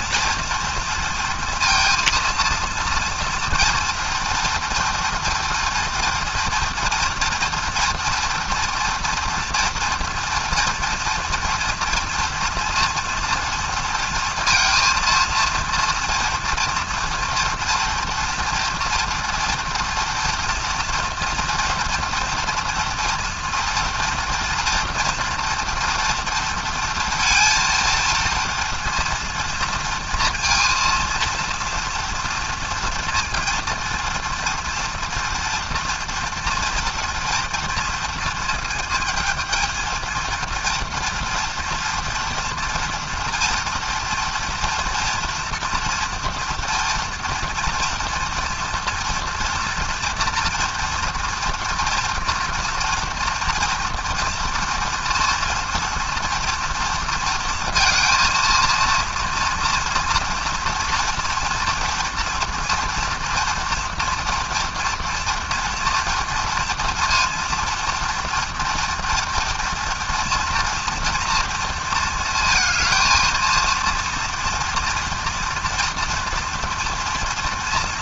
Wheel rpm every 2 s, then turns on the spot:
230, 230, 230, 230, 230, 230, 230, 230, 230, 230, 230, 230, 240, 230, 230, 230, 230, 230, 230, 220, 230, 230, 240, 230, 230, 230, 230, 230, 230, 230, 230, 230, 230, 230, 230, 230, 220, 230, 230.
none